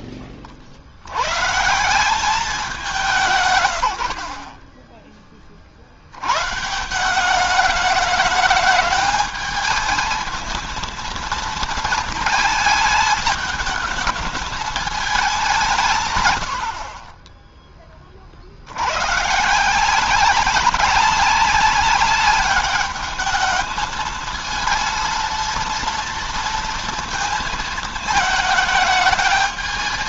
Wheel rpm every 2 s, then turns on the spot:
80, 180, 10, 170, 210, 230, 220, 220, 70, 90, 190, 200, 230, 230, 220.
none